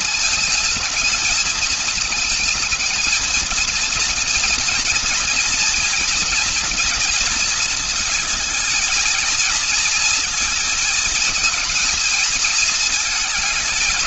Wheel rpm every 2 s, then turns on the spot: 220, 220, 240, 240, 220, 220, 220.
none